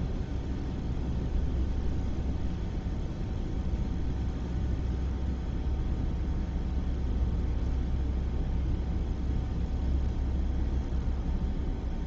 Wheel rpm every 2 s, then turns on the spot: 0, 0, 0, 0, 0, 0.
none